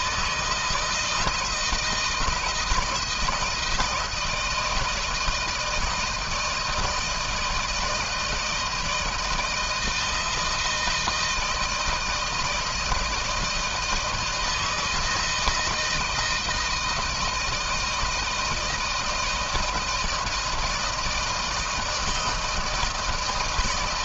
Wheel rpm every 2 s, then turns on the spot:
160, 170, 160, 160, 160, 160, 160, 160, 160, 160, 160, 160.
none